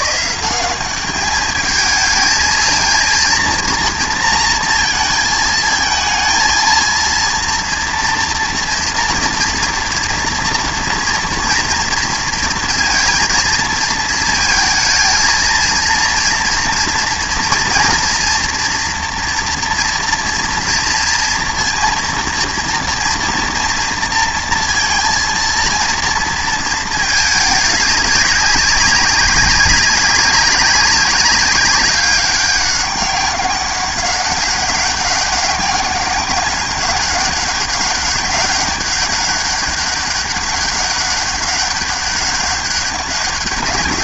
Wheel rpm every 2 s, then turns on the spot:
190, 230, 230, 230, 230, 230, 230, 230, 230, 230, 230, 230, 230, 230, 200, 190, 190, 200, 200, 200, 200, 200.
none